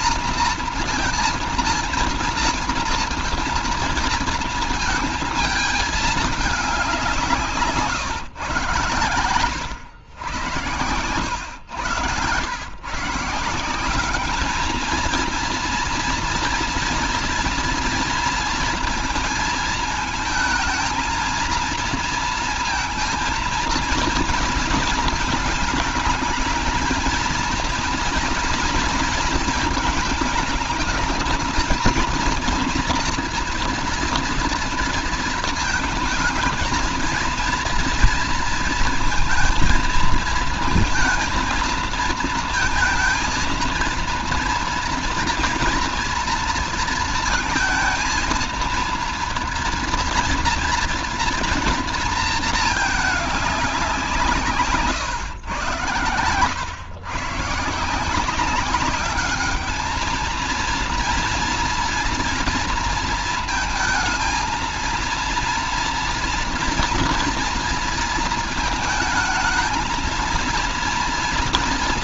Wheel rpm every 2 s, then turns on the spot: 230, 230, 230, 210, 130, 100, 120, 210, 230, 230, 220, 230, 230, 220, 240, 220, 230, 230, 220, 230, 230, 230, 230, 230, 230, 240, 220, 150, 120, 180, 230, 230, 220, 230, 220, 230.
none